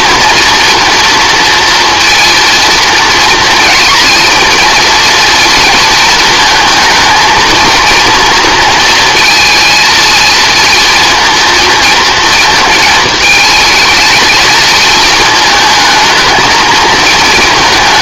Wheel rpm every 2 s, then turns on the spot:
230, 230, 230, 220, 230, 230, 220, 220, 220.
none